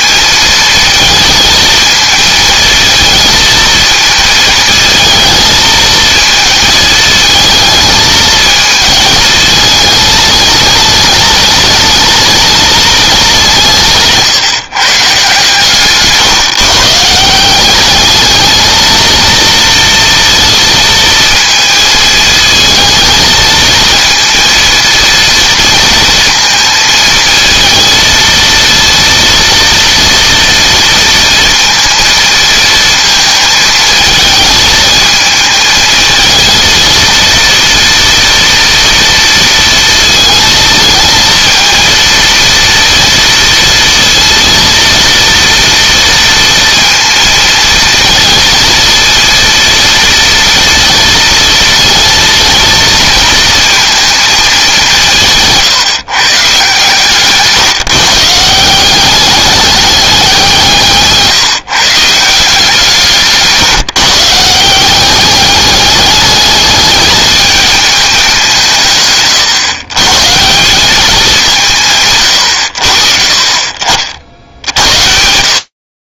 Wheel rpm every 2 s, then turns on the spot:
230, 220, 220, 220, 220, 210, 210, 150, 160, 230, 230, 220, 230, 220, 230, 230, 220, 220, 230, 230, 230, 230, 230, 230, 230, 230, 230, 170, 150, 190, 160, 170, 190, 210, 140, 200, 70, 70.
none